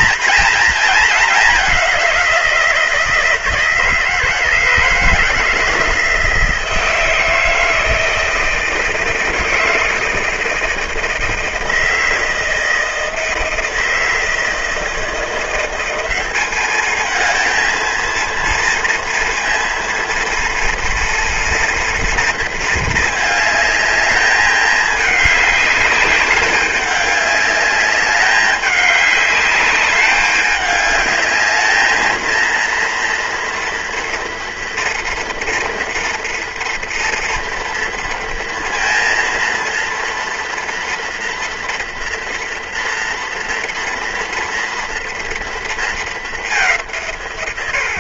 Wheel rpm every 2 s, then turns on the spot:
220, 170, 160, 170, 160, 160, 160, 160, 210, 230, 230, 230, 210, 200, 200, 210, 230, 230, 230, 230, 230, 230, 230, 200.
none